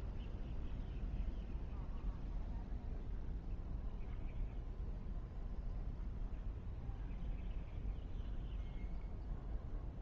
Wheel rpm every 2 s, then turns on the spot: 0, 0, 0, 0, 0.
none